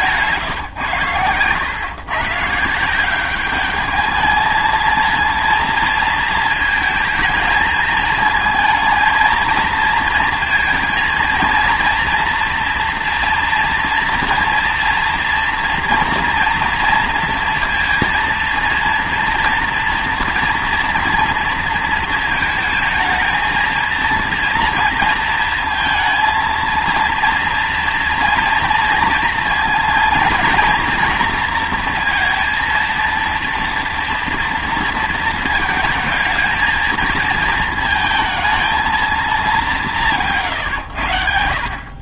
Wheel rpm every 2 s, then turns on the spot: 130, 160, 220, 220, 220, 220, 240, 230, 230, 230, 240, 220, 230, 230, 230, 230, 230, 230, 220, 220, 130.
none